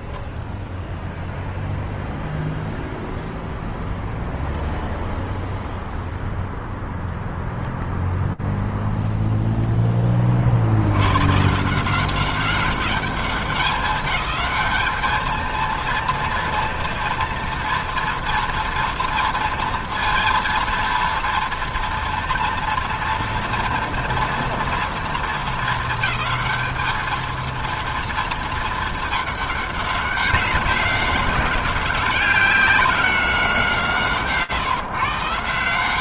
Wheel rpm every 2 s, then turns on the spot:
0, 0, 0, 0, 0, 30, 190, 190, 230, 240, 230, 230, 230, 220, 220, 190, 190, 140.
none